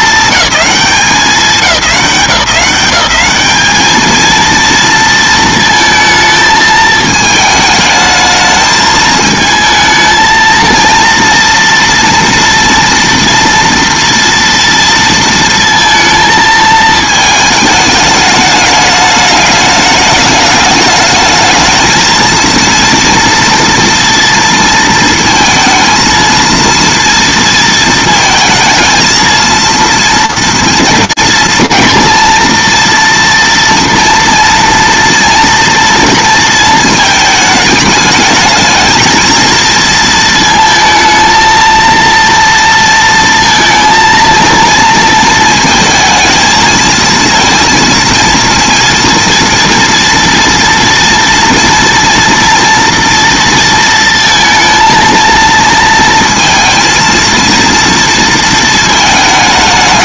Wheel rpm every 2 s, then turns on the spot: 210, 190, 230, 220, 220, 230, 230, 230, 220, 210, 210, 230, 230, 230, 220, 230, 230, 230, 230, 220, 230, 230, 230, 230, 230, 240, 230, 230, 230, 220.
none